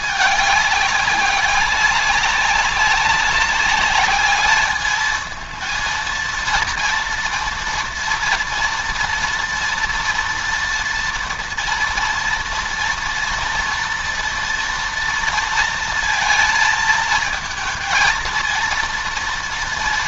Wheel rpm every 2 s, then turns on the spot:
200, 200, 210, 230, 230, 230, 230, 230, 230, 230.
none